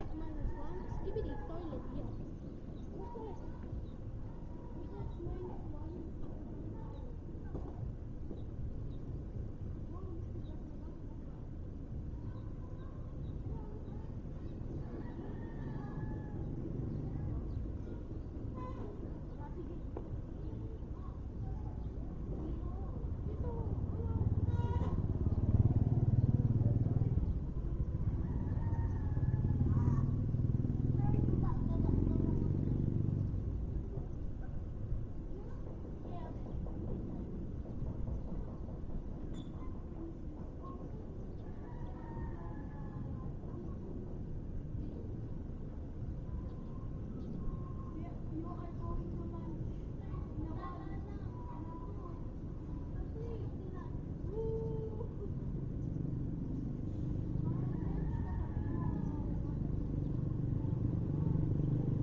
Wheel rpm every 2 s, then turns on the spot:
0, 0, 0, 0, 0, 0, 0, 0, 0, 0, 0, 0, 0, 0, 0, 0, 0, 0, 0, 0, 0, 0, 0, 0, 0, 0, 0, 0, 0, 0, 0.
none